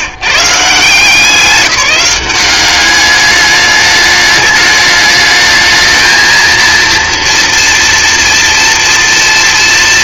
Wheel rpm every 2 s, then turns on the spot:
150, 200, 210, 230, 240.
none